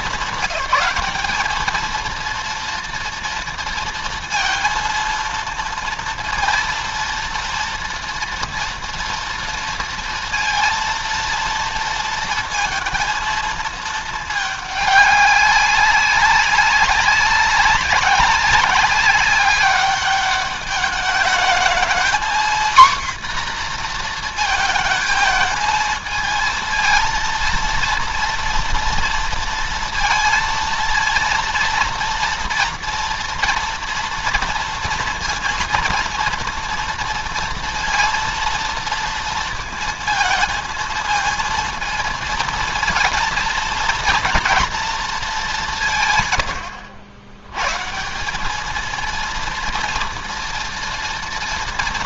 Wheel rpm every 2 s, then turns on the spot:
210, 230, 230, 230, 230, 230, 230, 210, 190, 200, 200, 240, 230, 230, 230, 230, 230, 230, 230, 230, 220, 230, 230, 110, 190, 230.
none